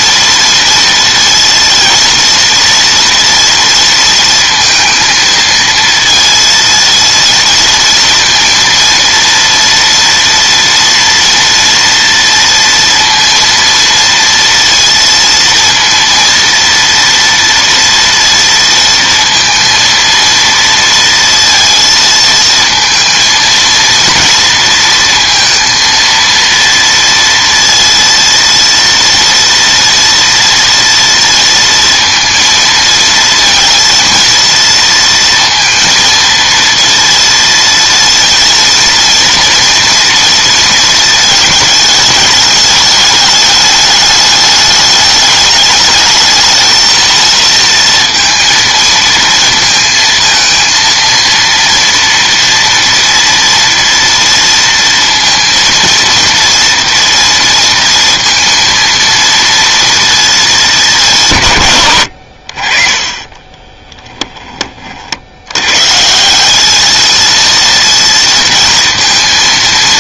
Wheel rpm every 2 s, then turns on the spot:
230, 240, 230, 230, 230, 230, 230, 230, 230, 230, 230, 230, 230, 230, 230, 230, 230, 230, 230, 230, 230, 210, 210, 230, 230, 230, 230, 230, 230, 230, 200, 40, 30, 210, 230.
none